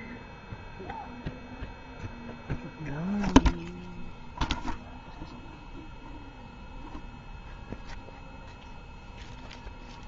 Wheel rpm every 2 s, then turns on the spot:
0, 0, 0, 0, 0.
none